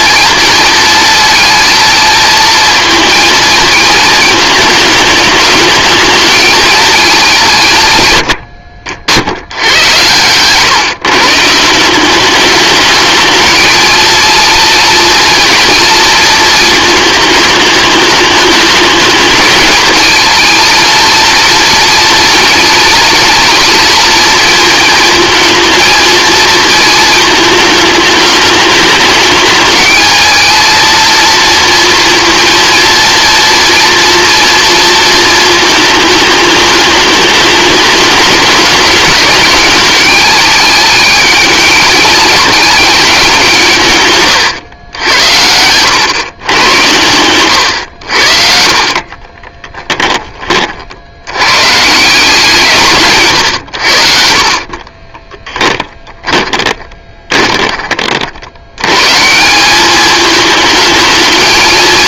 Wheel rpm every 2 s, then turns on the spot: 230, 230, 210, 220, 70, 130, 210, 230, 220, 210, 220, 230, 230, 230, 210, 230, 230, 230, 210, 210, 210, 220, 100, 110, 60, 40, 160, 30, 10, 90, 220.
44-46 48-50 54-58